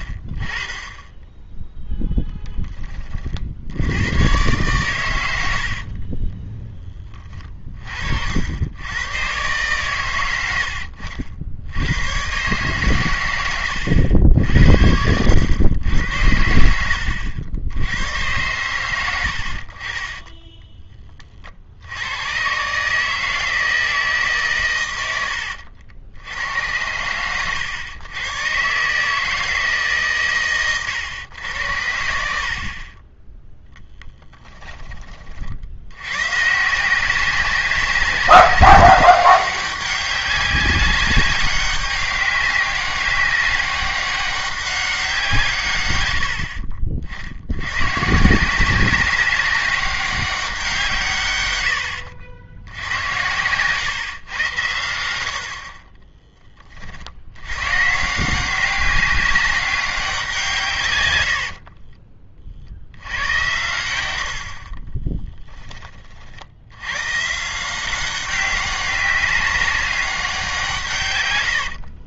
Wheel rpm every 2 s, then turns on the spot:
20, 10, 110, 10, 90, 80, 130, 70, 80, 110, 20, 130, 130, 90, 130, 130, 50, 10, 160, 200, 200, 200, 190, 50, 180, 180, 100, 110, 20, 190, 150, 60, 40, 90, 200, 170.
none